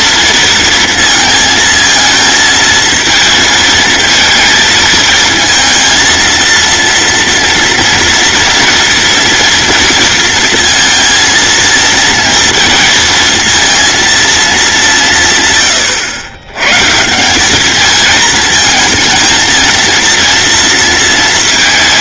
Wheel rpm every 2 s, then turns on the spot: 230, 220, 220, 230, 230, 220, 230, 210, 130, 220, 230.
none